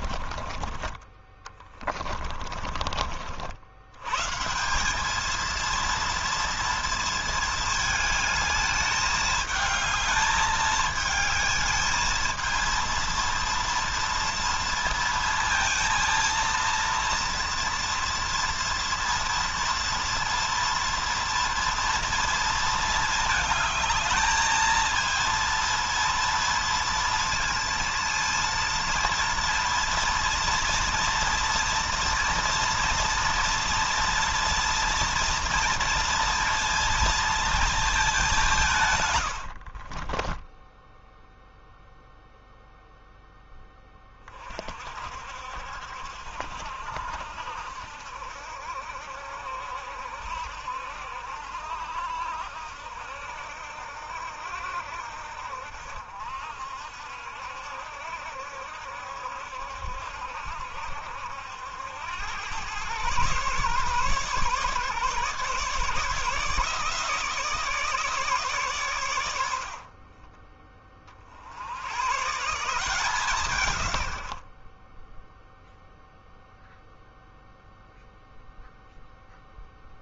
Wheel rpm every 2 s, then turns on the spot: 20, 50, 200, 230, 210, 220, 230, 230, 230, 230, 230, 220, 230, 230, 230, 230, 230, 230, 230, 130, 0, 0, 50, 70, 70, 70, 70, 60, 70, 70, 70, 120, 140, 160, 130, 30, 160, 20, 0, 0.
38-40